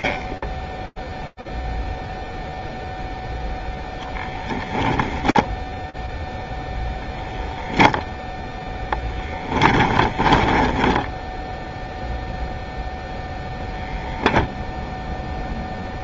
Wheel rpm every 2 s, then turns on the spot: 0, 0, 0, 10, 10, 0, 0, 10.
8-10